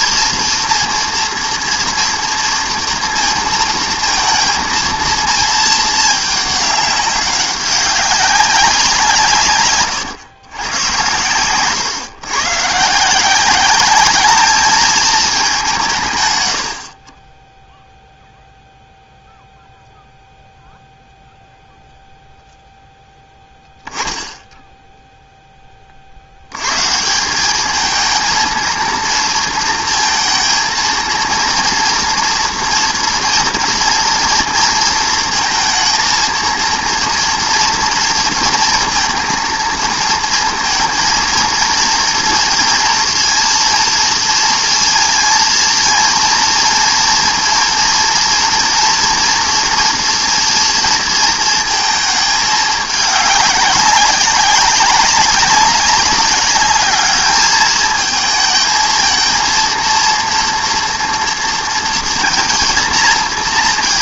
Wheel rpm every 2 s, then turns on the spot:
230, 230, 230, 200, 180, 120, 140, 220, 80, 0, 0, 0, 10, 110, 230, 230, 230, 230, 230, 230, 230, 230, 230, 230, 230, 230, 210, 190, 210, 220, 230, 230.
none